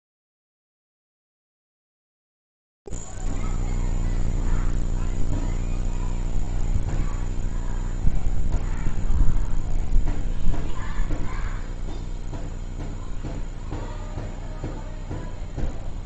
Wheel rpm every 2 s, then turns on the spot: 0, 0, 0, 0, 0, 0, 0, 0.
none